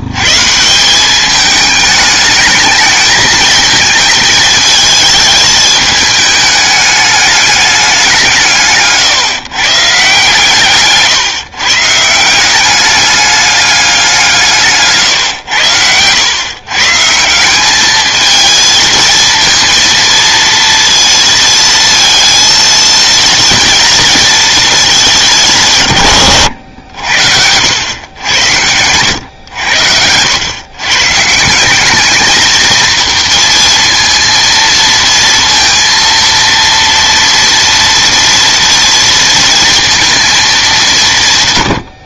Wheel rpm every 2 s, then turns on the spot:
170, 220, 220, 210, 150, 140, 200, 150, 140, 230, 230, 230, 210, 70, 100, 130, 230, 230, 230, 230, 200.
none